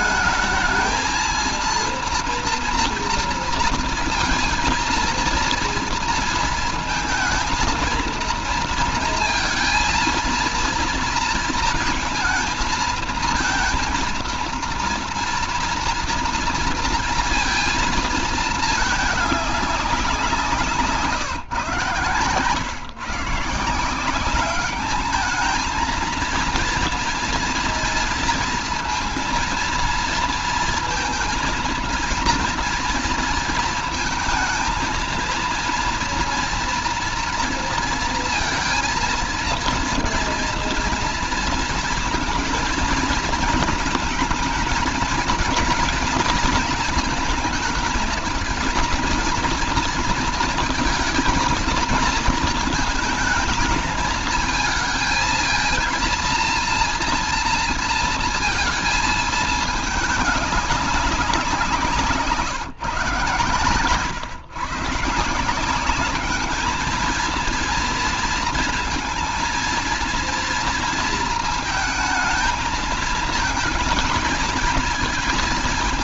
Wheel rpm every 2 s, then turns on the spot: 220, 230, 230, 230, 230, 230, 230, 240, 240, 210, 150, 150, 210, 230, 230, 230, 230, 230, 230, 230, 230, 230, 220, 220, 230, 230, 220, 220, 240, 220, 190, 140, 160, 220, 230, 230, 220, 220.
none